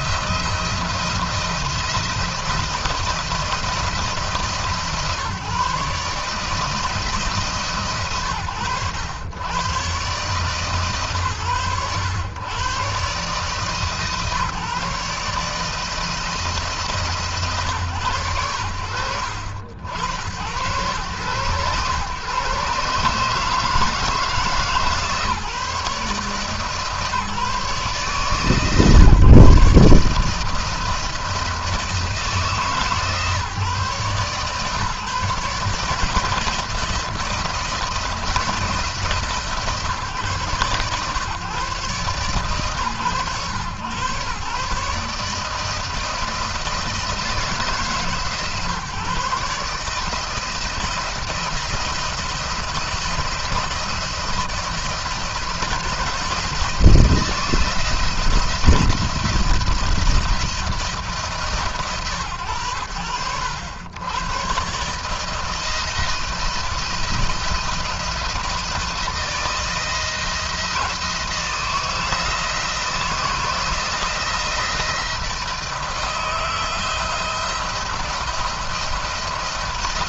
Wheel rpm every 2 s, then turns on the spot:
170, 170, 140, 160, 120, 140, 120, 150, 160, 90, 110, 140, 150, 150, 150, 160, 160, 140, 160, 160, 120, 110, 140, 160, 150, 170, 170, 170, 170, 170, 170, 80, 130, 170, 170, 160, 160, 170, 160, 170.
none